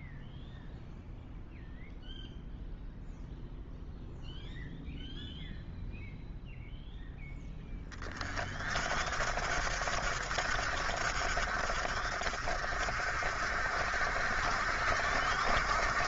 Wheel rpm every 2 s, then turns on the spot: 0, 0, 0, 0, 50, 60, 50, 60.
none